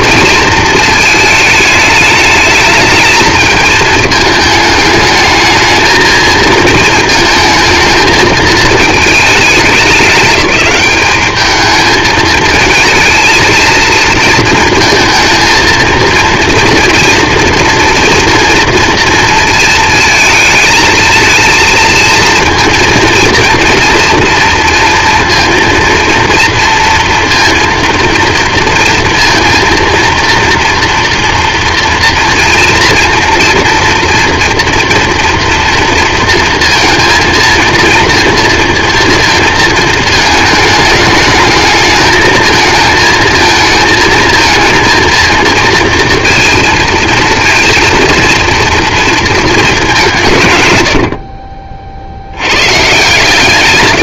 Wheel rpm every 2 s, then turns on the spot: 230, 220, 220, 220, 220, 200, 220, 230, 230, 230, 220, 230, 230, 230, 230, 230, 230, 240, 230, 230, 220, 220, 220, 230, 230, 120, 110.
none